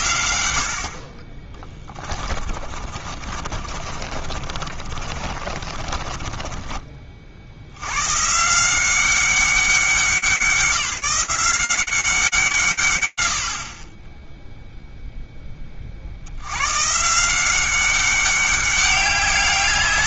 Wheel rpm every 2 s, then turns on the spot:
70, 40, 40, 30, 170, 180, 140, 0, 120, 200.
2-8